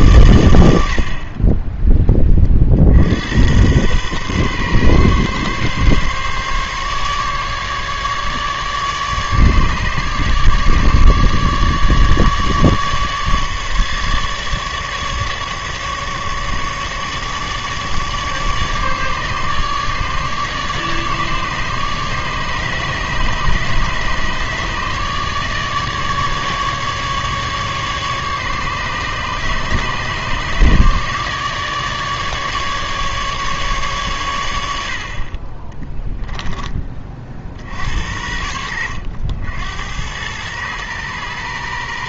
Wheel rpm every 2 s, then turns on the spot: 90, 40, 130, 140, 150, 150, 150, 150, 150, 150, 150, 150, 150, 150, 150, 150, 150, 90, 10, 80, 110.
none